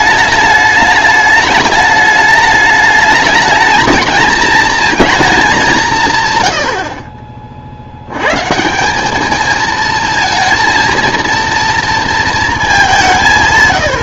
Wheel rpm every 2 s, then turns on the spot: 210, 210, 230, 90, 160, 230, 210.
none